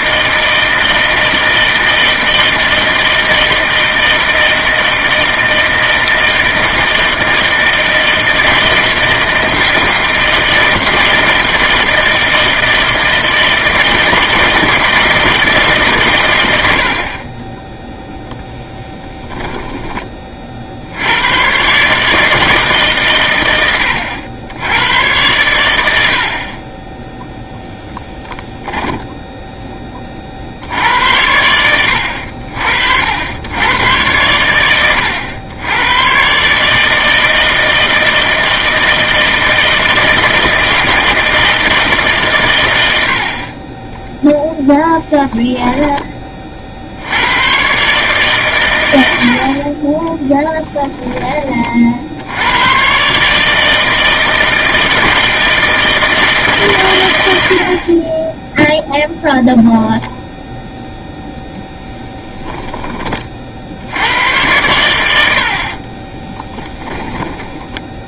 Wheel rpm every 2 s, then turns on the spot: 160, 160, 160, 160, 160, 160, 160, 160, 60, 10, 70, 140, 100, 20, 10, 70, 60, 100, 150, 160, 160, 80, 10, 60, 100, 20, 130, 160, 120, 0, 0, 20, 90, 20.
18-20 28-30 66-68